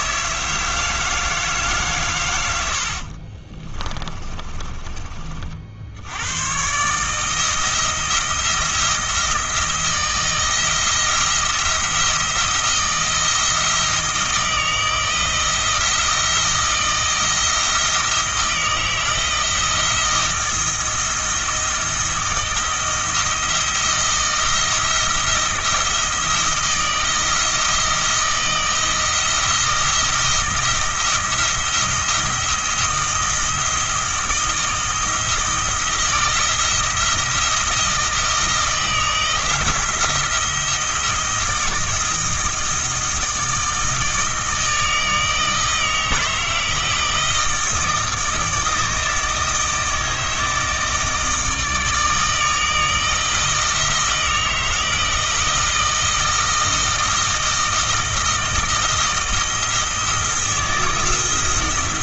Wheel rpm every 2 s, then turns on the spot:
160, 70, 40, 140, 170, 170, 170, 160, 170, 160, 170, 170, 160, 170, 170, 170, 170, 160, 160, 160, 170, 160, 160, 160, 160, 160, 160, 160, 160, 160, 160.
4-6